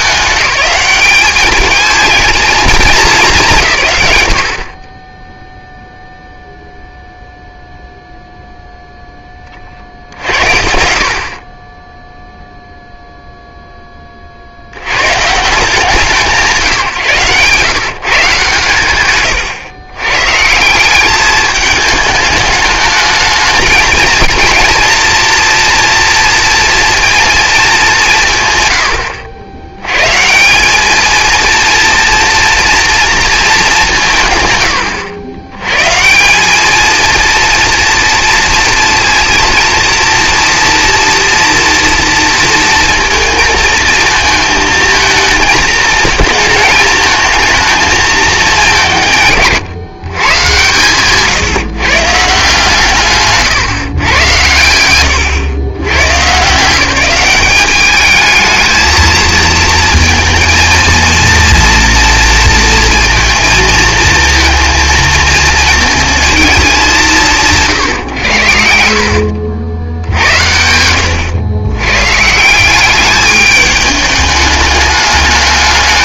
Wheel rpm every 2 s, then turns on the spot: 200, 210, 40, 0, 0, 70, 0, 50, 140, 120, 180, 220, 230, 230, 110, 200, 230, 110, 220, 230, 230, 230, 230, 230, 170, 140, 150, 80, 180, 220, 230, 230, 230, 200, 70, 80, 180, 210.
none